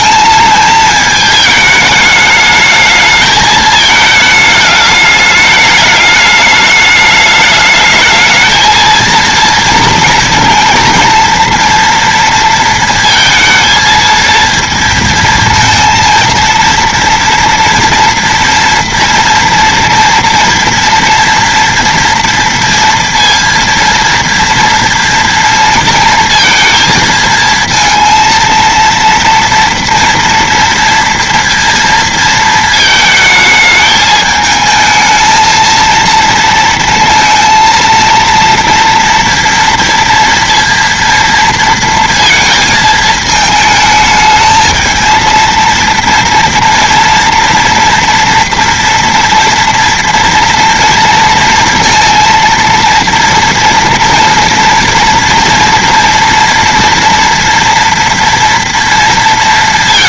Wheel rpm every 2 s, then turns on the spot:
220, 220, 210, 210, 230, 230, 230, 230, 230, 240, 240, 230, 230, 230, 230, 230, 220, 220, 230, 230, 230, 220, 220, 230, 230, 230, 230, 230, 230, 230.
none